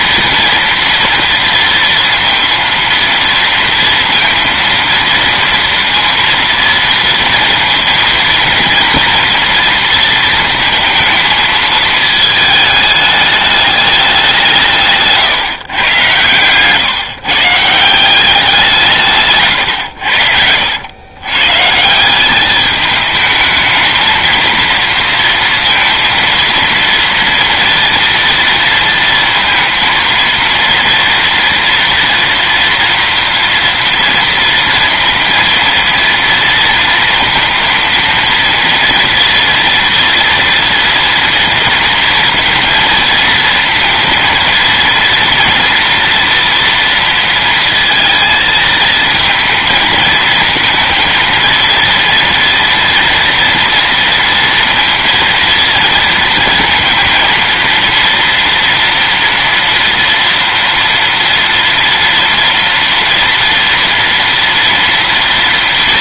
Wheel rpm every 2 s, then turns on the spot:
240, 230, 230, 230, 240, 230, 220, 160, 130, 180, 90, 210, 230, 230, 230, 230, 230, 230, 230, 230, 230, 230, 230, 230, 230, 230, 240, 230, 220, 230, 230, 230, 230.
none